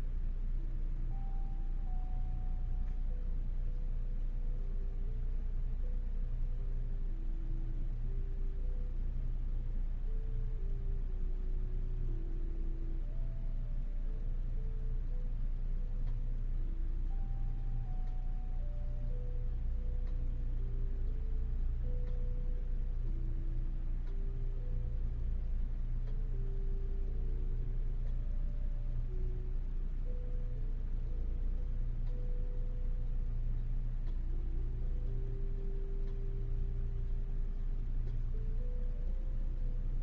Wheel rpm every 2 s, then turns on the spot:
0, 0, 0, 0, 0, 0, 0, 0, 0, 0, 0, 0, 0, 0, 0, 0, 0, 0, 0, 0.
none